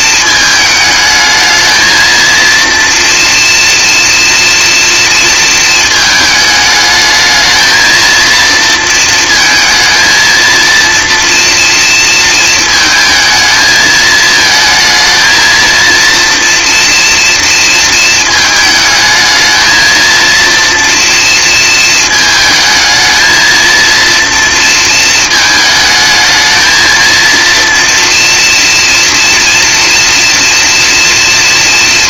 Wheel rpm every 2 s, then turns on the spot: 220, 240, 220, 220, 230, 230, 220, 230, 230, 220, 230, 230, 220, 230, 230, 230.
none